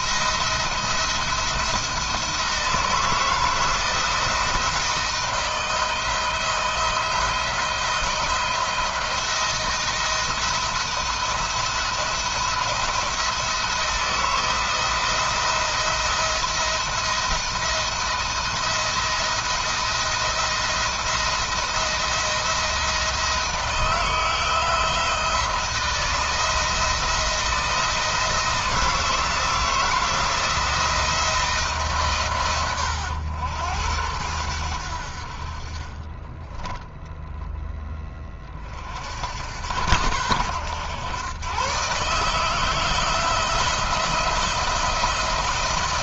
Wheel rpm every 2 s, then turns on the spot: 170, 160, 160, 160, 170, 170, 170, 170, 170, 170, 170, 170, 170, 170, 160, 170, 110, 70, 0, 60, 110, 160, 170.
none